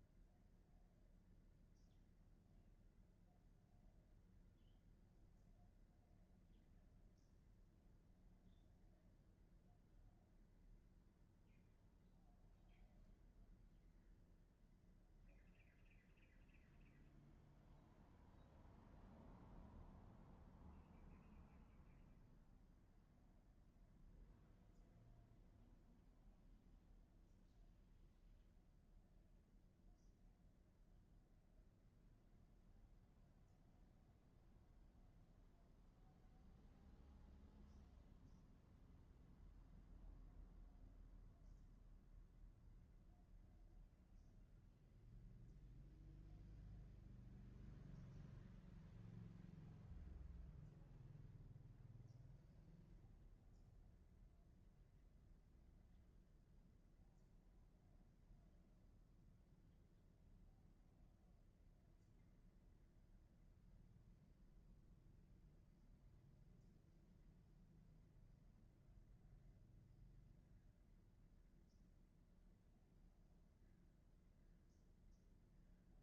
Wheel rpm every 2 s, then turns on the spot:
0, 0, 0, 0, 0, 0, 0, 0, 0, 0, 0, 0, 0, 0, 0, 0, 0, 0, 0, 0, 0, 0, 0, 0, 0, 0, 0, 0, 0, 0, 0, 0, 0, 0, 0, 0, 0, 0.
none